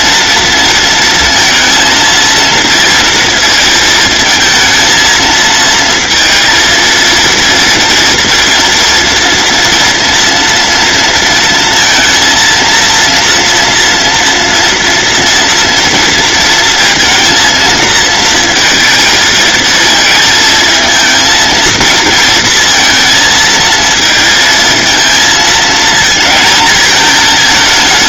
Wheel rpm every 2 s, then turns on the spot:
220, 230, 220, 230, 240, 230, 230, 230, 230, 220, 220, 230, 220, 220.
none